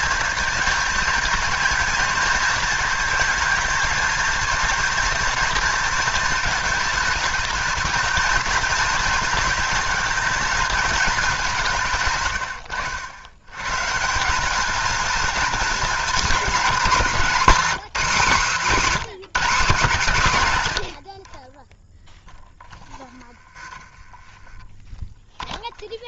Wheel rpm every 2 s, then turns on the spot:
230, 220, 230, 220, 230, 220, 110, 210, 220, 230, 130, 10, 10.
22-26